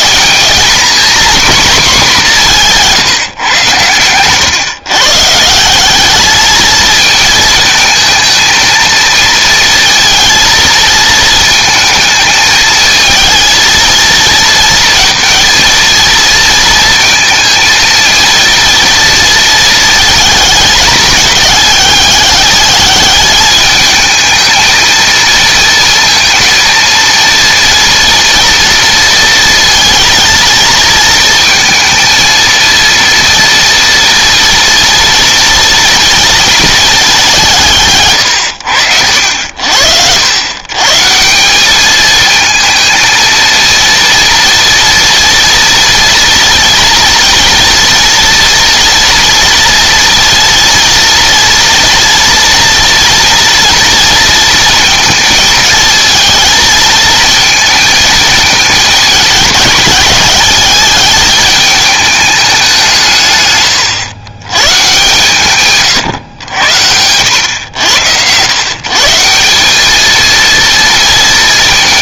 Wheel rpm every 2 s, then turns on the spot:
240, 180, 130, 220, 230, 230, 220, 230, 230, 230, 220, 210, 220, 220, 230, 230, 230, 230, 220, 90, 130, 220, 230, 230, 230, 230, 240, 230, 220, 210, 210, 190, 120, 90, 130, 230.
none